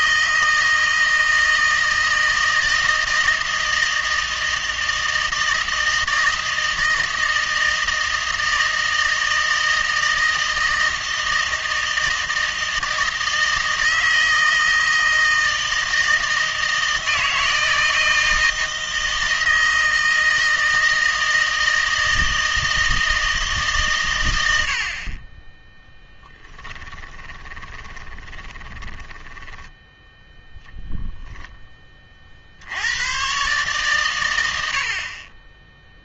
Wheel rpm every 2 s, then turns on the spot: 160, 160, 160, 160, 160, 160, 160, 160, 160, 160, 160, 160, 70, 10, 20, 0, 70, 70.
26-30